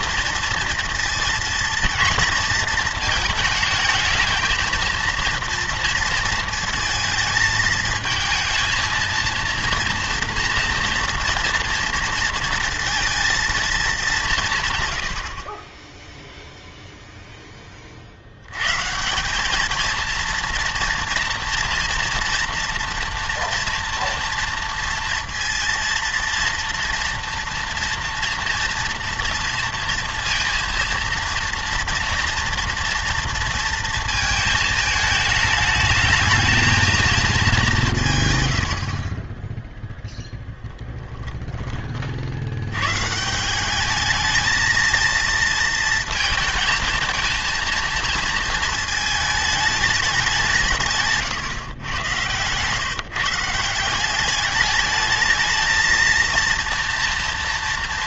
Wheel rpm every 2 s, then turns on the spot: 230, 220, 230, 230, 230, 230, 230, 150, 0, 120, 230, 240, 230, 230, 230, 230, 230, 220, 220, 90, 20, 100, 220, 230, 220, 160, 140, 210, 230.
40-42